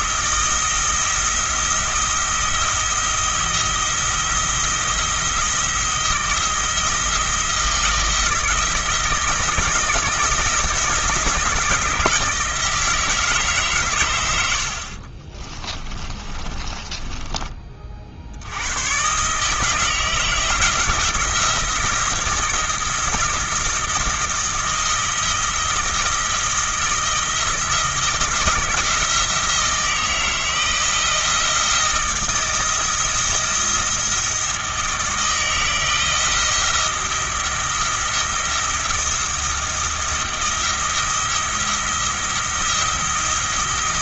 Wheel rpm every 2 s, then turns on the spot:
170, 170, 170, 170, 160, 170, 160, 70, 30, 90, 160, 170, 170, 170, 160, 160, 160, 160, 170, 170, 170, 170.
16-18